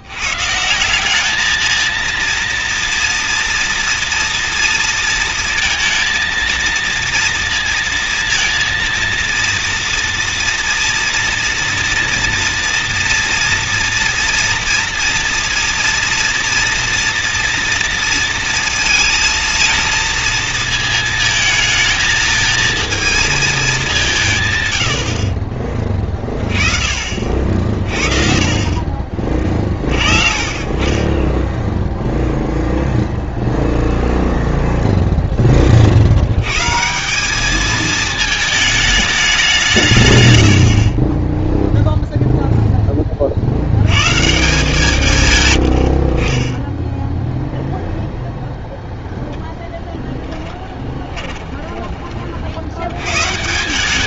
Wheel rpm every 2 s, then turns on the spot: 160, 230, 230, 230, 230, 230, 230, 230, 230, 230, 220, 220, 100, 40, 40, 30, 0, 0, 130, 220, 70, 10, 160, 10, 0, 10, 70.
40-42 50-52